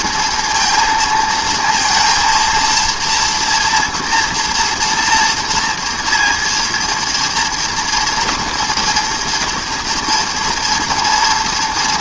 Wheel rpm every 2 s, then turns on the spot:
220, 230, 230, 240, 230, 240.
none